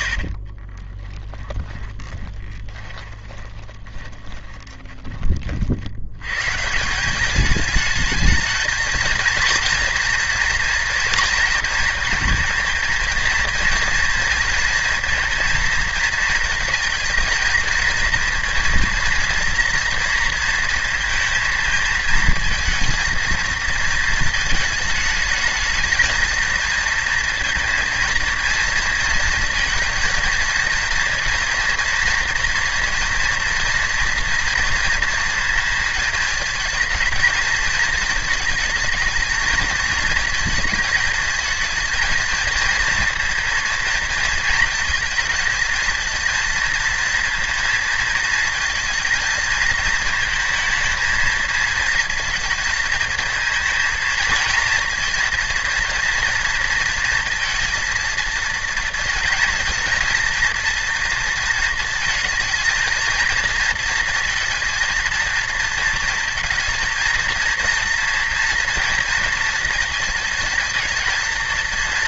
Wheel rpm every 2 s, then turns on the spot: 20, 20, 20, 170, 220, 230, 230, 230, 230, 230, 230, 220, 220, 230, 230, 230, 230, 230, 220, 220, 220, 230, 220, 230, 230, 220, 220, 230, 230, 230, 230, 230, 230, 230, 230, 220.
0-6